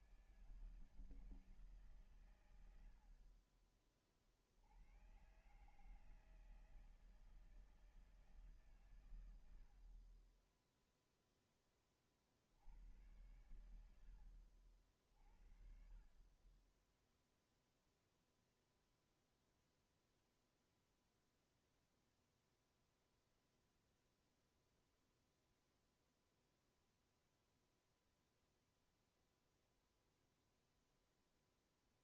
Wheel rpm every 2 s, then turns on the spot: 160, 120, 60, 160, 150, 30, 50, 70, 30, 0, 0, 0, 0, 0, 0, 0.
none